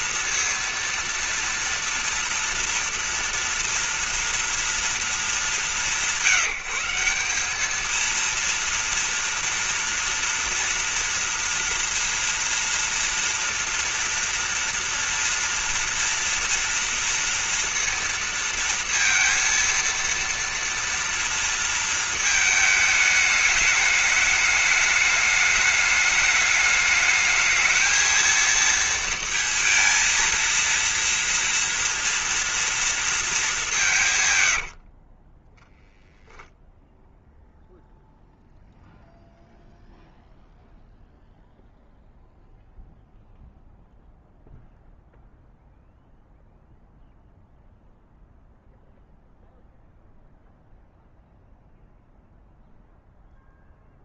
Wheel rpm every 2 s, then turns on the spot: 230, 230, 230, 190, 230, 230, 240, 230, 230, 230, 230, 220, 210, 210, 230, 230, 230, 110, 10, 0, 0, 0, 0, 0, 0, 0, 0.
34-36